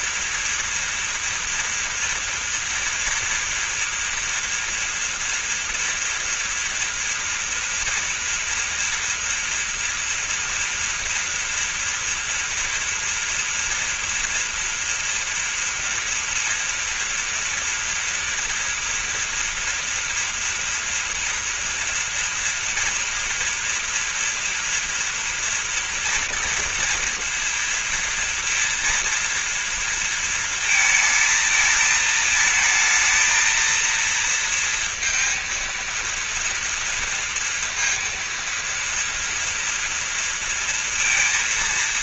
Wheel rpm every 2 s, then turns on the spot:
230, 230, 230, 230, 230, 230, 230, 230, 230, 240, 230, 230, 230, 230, 230, 230, 220, 230, 230, 230, 230.
none